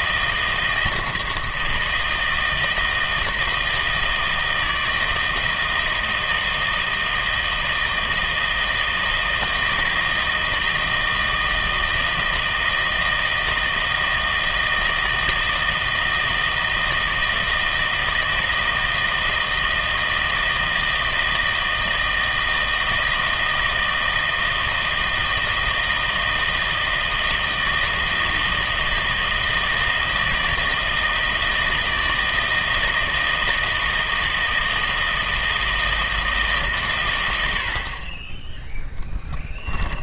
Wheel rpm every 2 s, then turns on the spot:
160, 160, 160, 160, 160, 160, 160, 160, 160, 160, 160, 160, 160, 160, 160, 160, 160, 160, 140, 10.
38-40